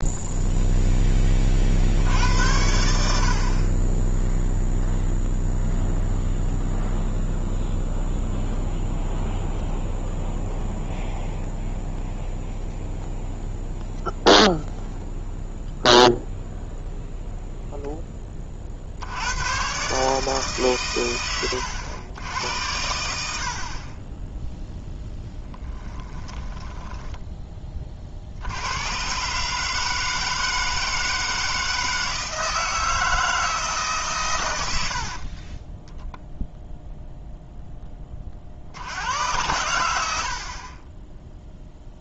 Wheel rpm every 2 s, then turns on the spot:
0, 80, 0, 0, 0, 0, 0, 0, 0, 40, 140, 90, 0, 10, 90, 160, 160, 100, 10, 60, 30.
26-28